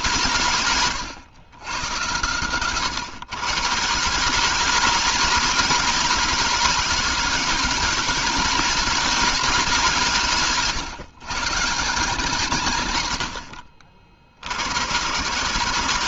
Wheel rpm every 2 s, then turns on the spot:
140, 130, 180, 200, 210, 140, 110, 130.
none